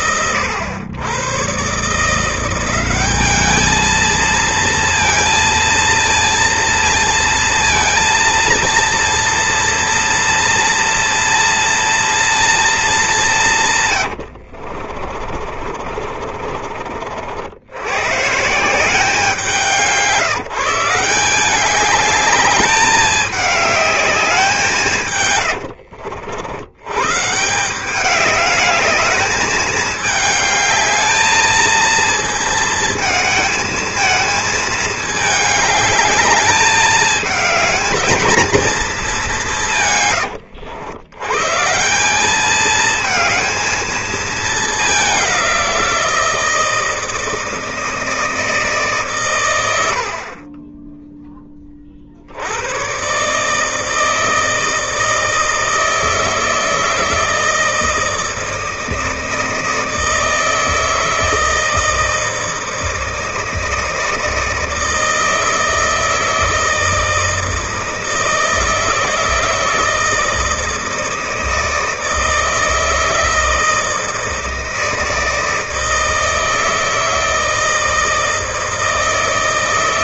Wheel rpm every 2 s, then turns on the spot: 110, 180, 230, 230, 230, 230, 230, 60, 40, 160, 170, 210, 180, 90, 200, 210, 230, 220, 210, 220, 90, 210, 210, 160, 160, 30, 90, 160, 160, 160, 160, 160, 160, 160, 160, 160, 160, 160, 160, 160.
14-18